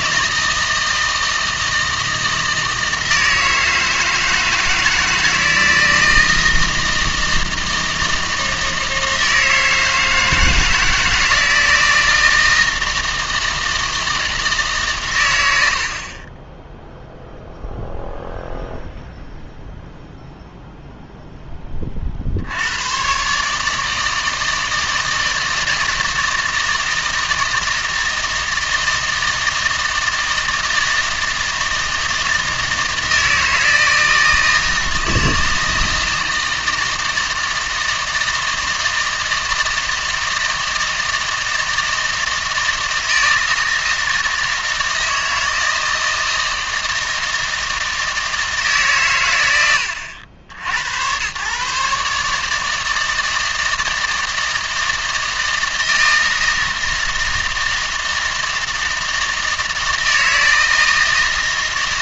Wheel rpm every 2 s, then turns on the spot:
160, 160, 160, 160, 160, 160, 160, 140, 0, 0, 0, 120, 160, 160, 160, 160, 160, 160, 160, 160, 160, 160, 160, 160, 150, 90, 160, 160, 160, 160, 160.
none